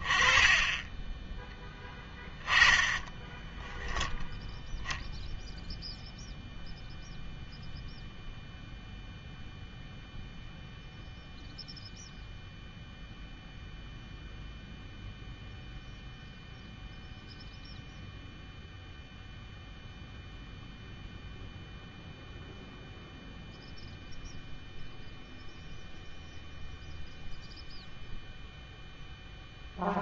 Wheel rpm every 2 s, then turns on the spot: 20, 10, 0, 0, 0, 0, 0, 0, 0, 0, 0, 0, 0, 0, 0.
none